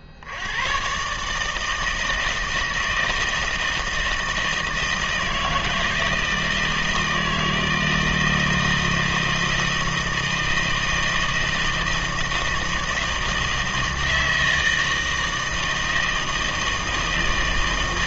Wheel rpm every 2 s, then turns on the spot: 60, 160, 160, 160, 160, 160, 160, 160, 160.
none